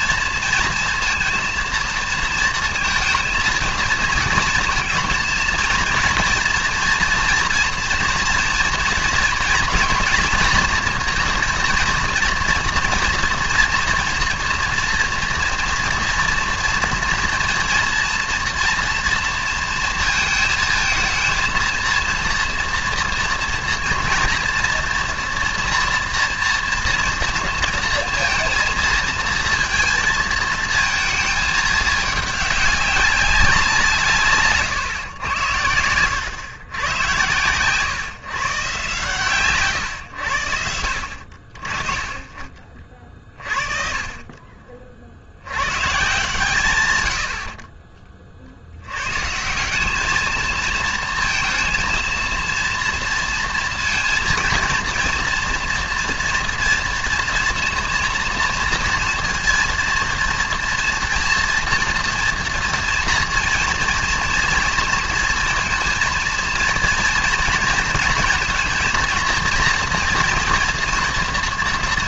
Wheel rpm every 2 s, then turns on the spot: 230, 230, 230, 240, 230, 230, 230, 230, 230, 230, 220, 230, 230, 230, 230, 230, 200, 140, 110, 140, 80, 40, 30, 120, 70, 220, 230, 230, 230, 230, 230, 230, 230, 230, 230, 230.
none